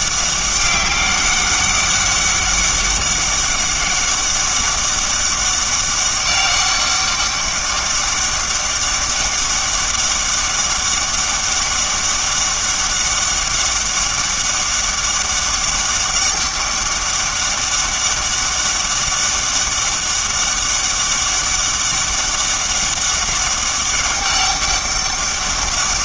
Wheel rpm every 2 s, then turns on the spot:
200, 200, 200, 200, 200, 200, 200, 200, 200, 200, 200, 200, 200.
none